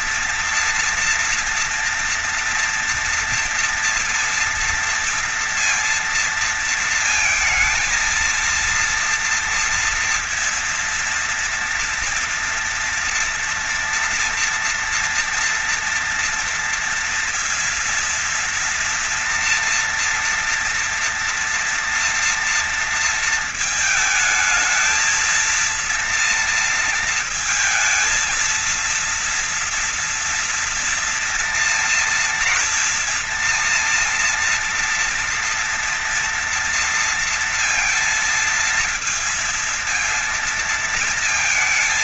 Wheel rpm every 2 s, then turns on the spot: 230, 230, 230, 230, 230, 230, 230, 230, 240, 230, 230, 230, 220, 230, 230, 230, 230, 240, 230, 230, 230.
none